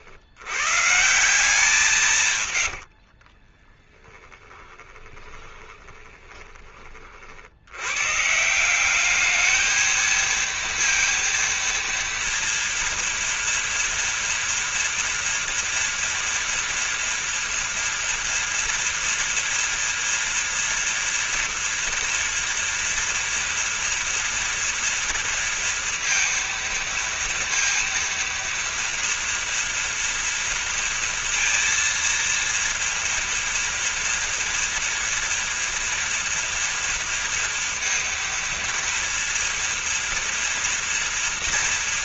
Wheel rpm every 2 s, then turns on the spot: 140, 80, 20, 30, 190, 230, 230, 230, 240, 230, 230, 230, 230, 230, 230, 230, 230, 230, 230, 230, 230.
2-6